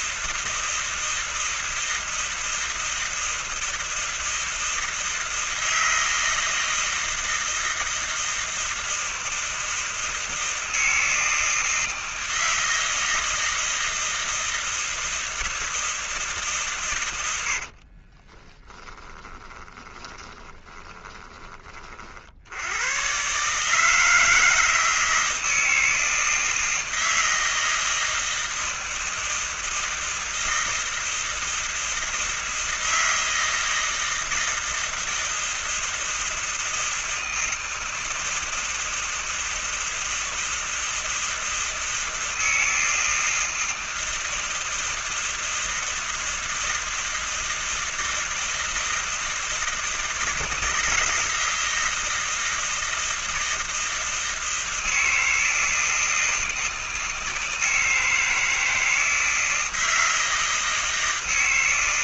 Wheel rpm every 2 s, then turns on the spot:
160, 160, 160, 160, 160, 160, 160, 160, 160, 40, 10, 50, 160, 160, 160, 160, 160, 160, 160, 160, 160, 160, 160, 160, 160, 160, 160, 160, 160, 160, 160.
18-22